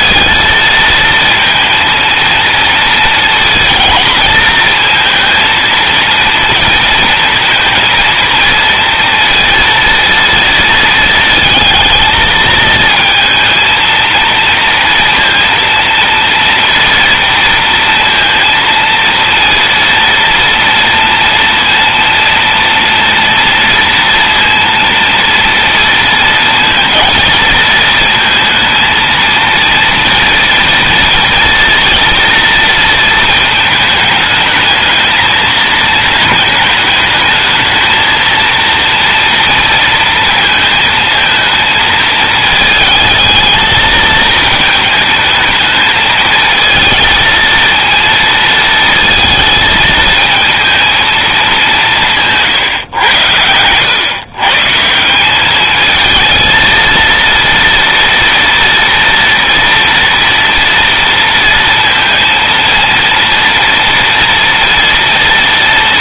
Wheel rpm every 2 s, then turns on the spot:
230, 230, 220, 220, 230, 220, 230, 230, 230, 230, 230, 230, 230, 230, 230, 230, 230, 220, 220, 230, 220, 220, 220, 220, 220, 220, 120, 160, 230, 230, 230, 230, 240.
none